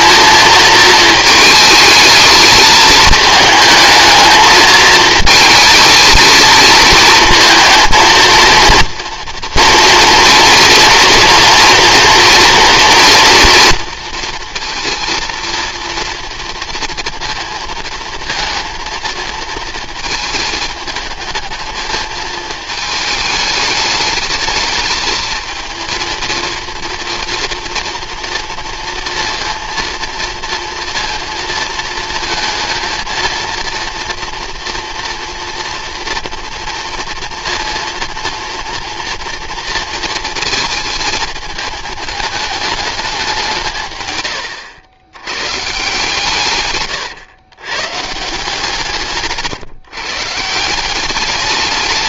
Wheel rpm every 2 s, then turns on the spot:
220, 220, 220, 220, 230, 230, 230, 230, 230, 230, 220, 220, 210, 230, 230, 230, 230, 230, 230, 230, 230, 210, 100, 130, 170, 180.
none